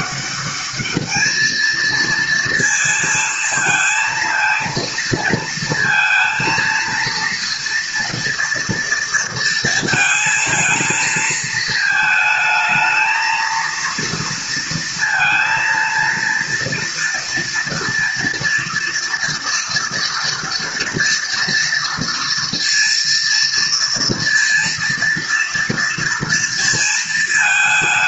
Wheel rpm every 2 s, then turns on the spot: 200, 230, 230, 230, 230, 220, 220, 230, 230, 230, 230, 230, 230, 230.
none